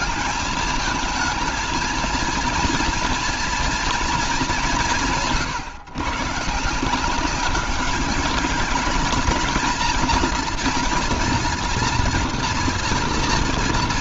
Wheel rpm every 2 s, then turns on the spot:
220, 230, 190, 170, 220, 230, 240.
none